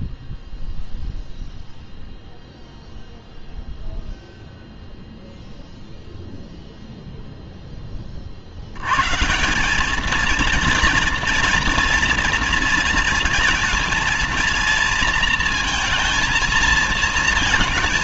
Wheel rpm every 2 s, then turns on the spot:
0, 0, 0, 0, 70, 230, 230, 230, 230.
none